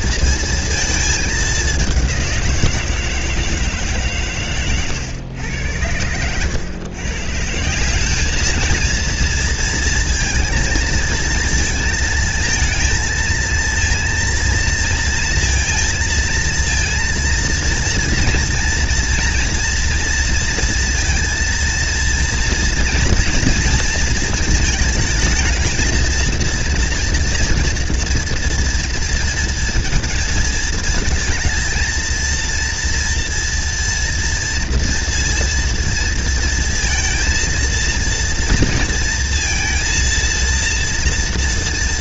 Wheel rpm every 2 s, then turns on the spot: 220, 160, 110, 130, 230, 220, 220, 230, 230, 230, 230, 230, 220, 230, 230, 230, 240, 230, 230, 230, 230.
none